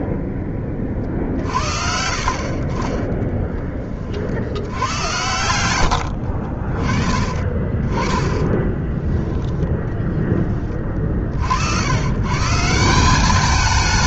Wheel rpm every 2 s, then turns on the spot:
20, 40, 80, 30, 20, 20, 160.
8-10